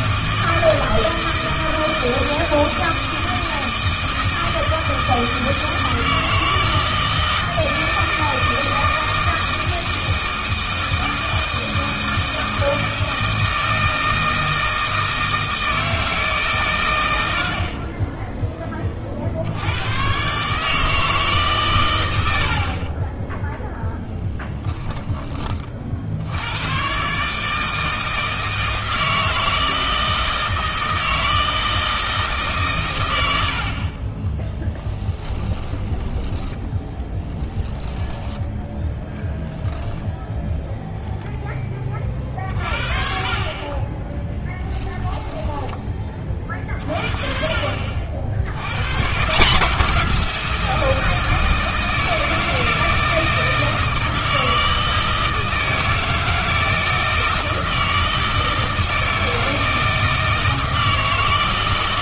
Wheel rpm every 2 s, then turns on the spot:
160, 160, 160, 160, 160, 160, 160, 160, 130, 20, 150, 50, 10, 120, 160, 160, 130, 10, 10, 0, 0, 40, 10, 40, 100, 170, 160, 160, 160, 160, 160.
34-36 44-46